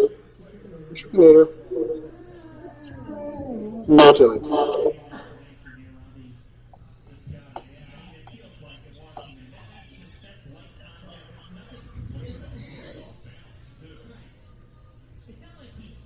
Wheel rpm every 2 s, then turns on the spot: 0, 0, 0, 0, 0, 0, 0, 0.
none